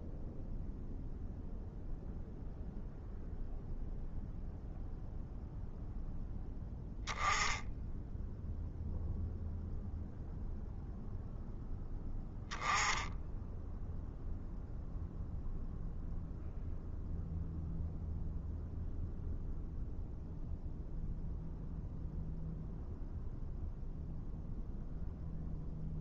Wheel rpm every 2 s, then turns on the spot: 0, 0, 0, 10, 0, 0, 10, 0, 0, 0, 0, 0, 0.
none